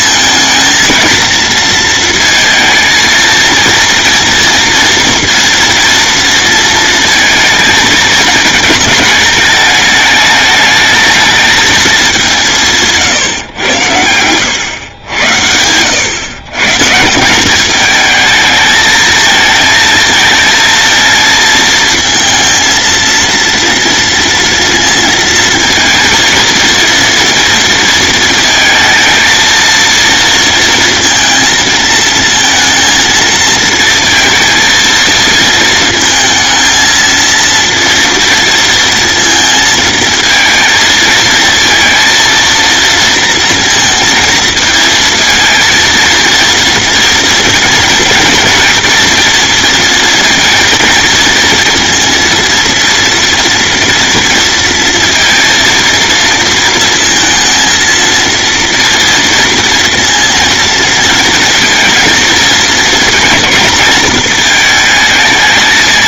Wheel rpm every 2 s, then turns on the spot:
220, 230, 240, 230, 220, 220, 160, 110, 150, 220, 230, 230, 230, 230, 220, 230, 230, 230, 230, 230, 230, 230, 220, 230, 230, 230, 230, 230, 230, 230, 230, 220, 220.
none